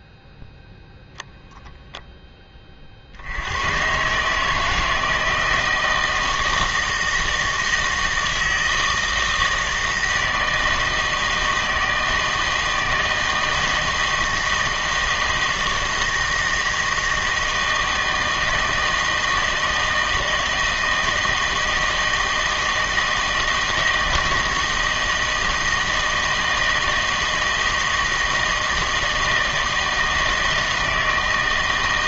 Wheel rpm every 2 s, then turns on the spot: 0, 30, 160, 160, 160, 160, 160, 160, 160, 160, 160, 160, 160, 160, 160, 160.
none